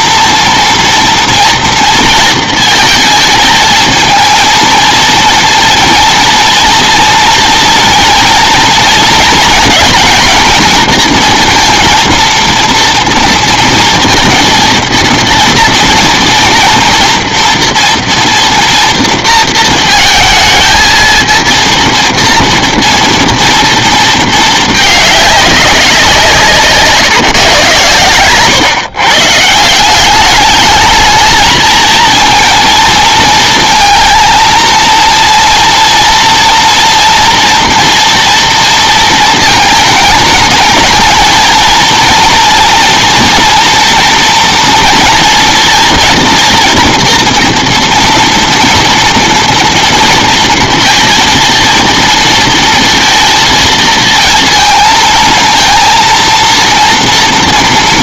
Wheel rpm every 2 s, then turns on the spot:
230, 220, 230, 230, 230, 230, 240, 230, 230, 230, 220, 230, 220, 150, 130, 210, 230, 230, 230, 230, 220, 230, 230, 240, 230, 230, 230, 220, 230.
none